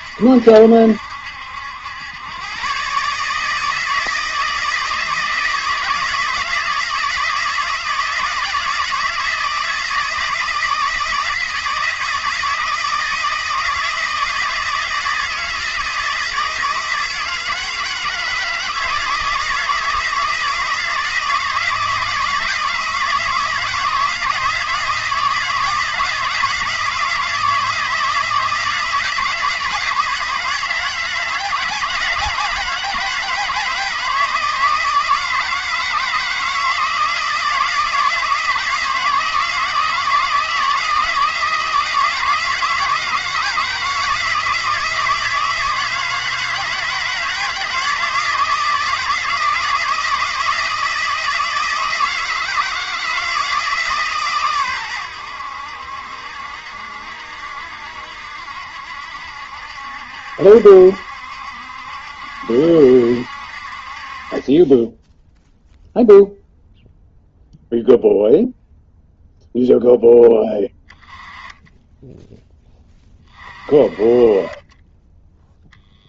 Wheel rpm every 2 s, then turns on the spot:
70, 130, 160, 160, 160, 160, 160, 160, 160, 160, 160, 160, 160, 160, 160, 160, 160, 160, 170, 160, 160, 160, 160, 160, 160, 160, 160, 110, 70, 70, 70, 70, 10, 0, 0, 10, 20, 20.
none